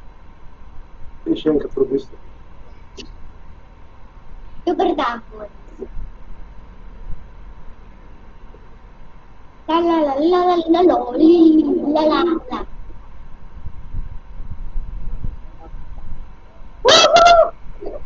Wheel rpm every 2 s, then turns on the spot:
0, 0, 0, 0, 0, 0, 0, 0, 0.
none